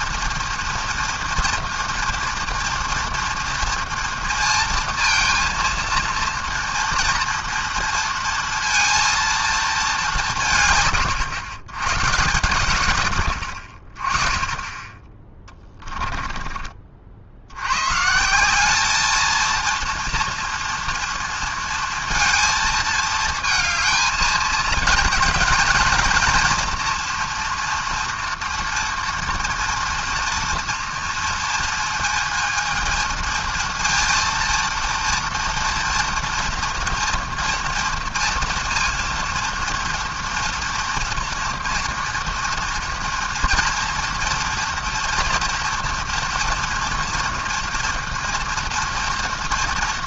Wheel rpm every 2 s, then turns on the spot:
230, 230, 230, 230, 230, 150, 110, 20, 30, 190, 230, 230, 220, 230, 230, 240, 220, 230, 230, 230, 230, 230, 230, 230, 230.
none